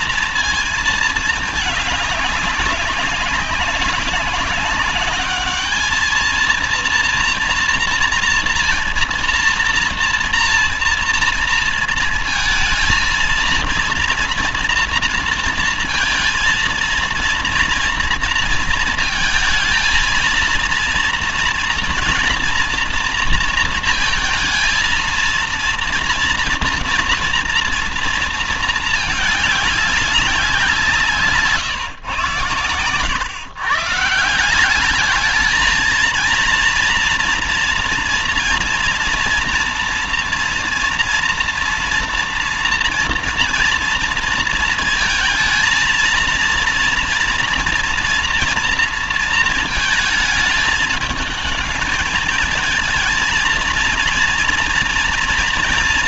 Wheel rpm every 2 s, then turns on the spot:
220, 200, 210, 230, 230, 230, 230, 230, 230, 230, 230, 230, 220, 230, 220, 170, 90, 200, 230, 230, 230, 230, 230, 230, 230, 210, 220, 240.
none